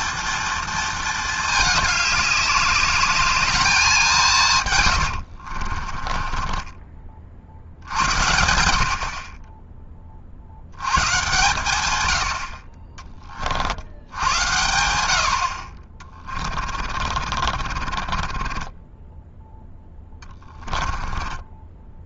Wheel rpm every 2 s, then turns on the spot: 220, 210, 70, 50, 30, 130, 40, 70, 40, 10, 10.
4-6 16-18 20-22